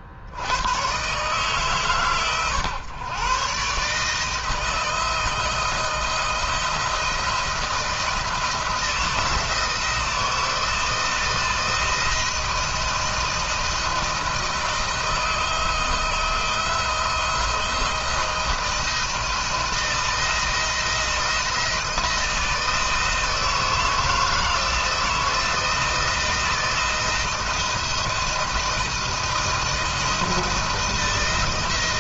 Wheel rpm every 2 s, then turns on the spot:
110, 120, 160, 160, 170, 160, 170, 160, 170, 170, 160, 160, 160, 160, 170, 160.
none